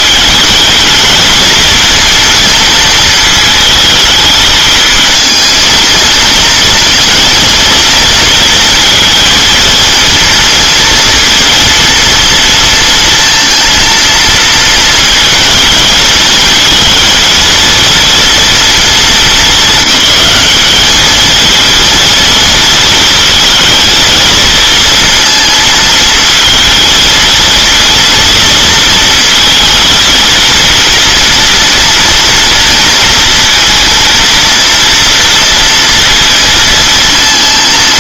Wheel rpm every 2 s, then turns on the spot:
220, 230, 230, 230, 230, 230, 230, 230, 220, 220, 210, 230, 230, 230, 230, 230, 230, 230, 230.
none